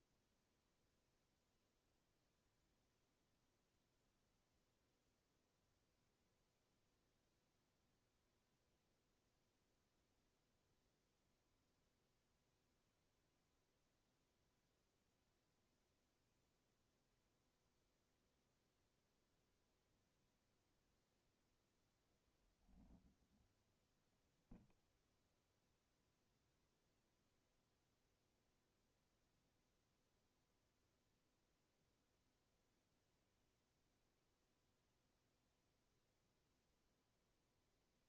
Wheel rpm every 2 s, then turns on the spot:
0, 0, 0, 0, 0, 0, 0, 0, 0, 0, 0, 0, 0, 0, 0, 0, 0, 0, 0.
none